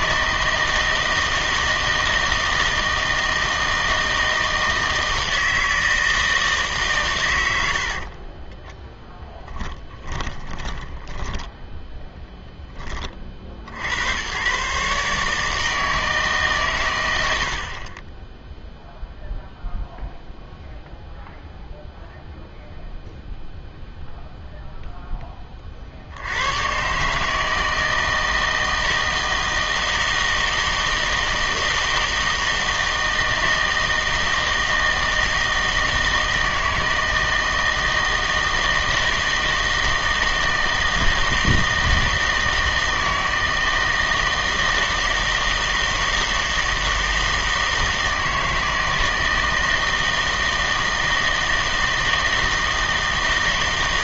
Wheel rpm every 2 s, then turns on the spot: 160, 160, 160, 150, 10, 20, 20, 140, 130, 0, 0, 0, 0, 120, 160, 160, 160, 160, 160, 160, 160, 160, 160, 160, 160, 160, 160.
8-12